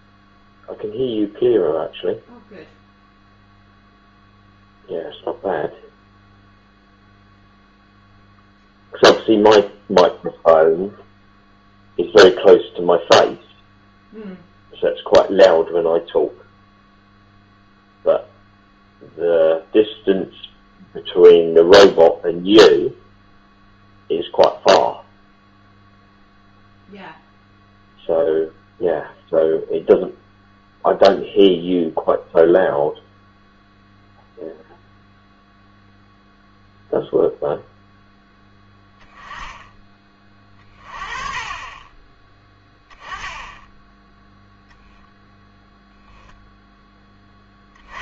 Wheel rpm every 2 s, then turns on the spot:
0, 0, 0, 0, 0, 0, 0, 0, 0, 0, 0, 0, 0, 0, 0, 0, 0, 0, 0, 10, 30, 10, 0, 10.
none